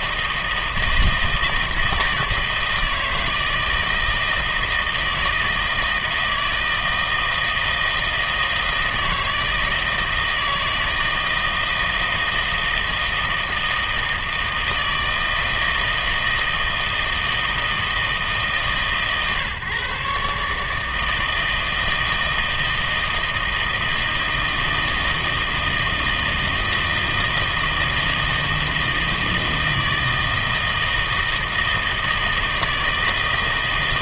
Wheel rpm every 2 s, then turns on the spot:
160, 160, 160, 160, 160, 160, 160, 160, 160, 140, 150, 160, 160, 160, 160, 160, 160.
none